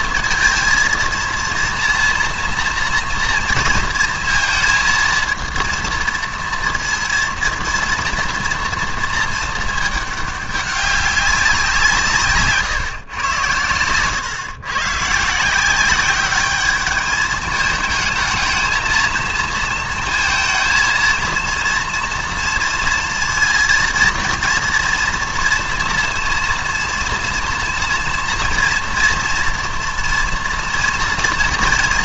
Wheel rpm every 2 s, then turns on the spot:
230, 230, 230, 230, 230, 200, 130, 130, 210, 220, 220, 230, 230, 230, 230, 230.
none